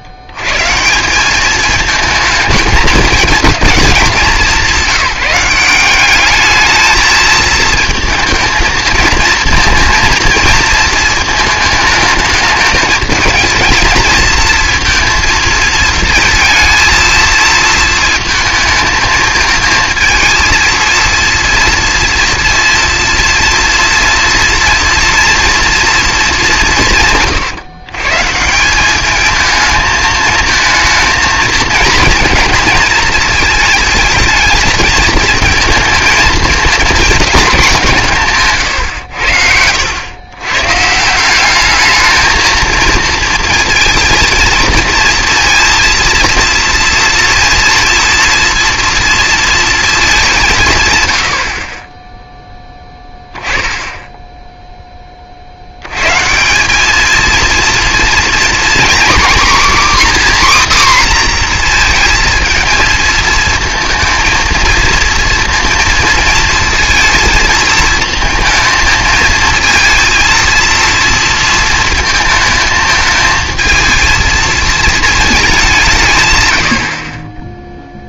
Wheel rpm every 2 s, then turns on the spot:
100, 220, 190, 210, 220, 220, 210, 220, 230, 220, 230, 230, 240, 190, 190, 220, 230, 220, 220, 130, 130, 230, 230, 230, 230, 160, 10, 0, 180, 240, 270, 230, 230, 230, 230, 230, 220, 230, 100.
none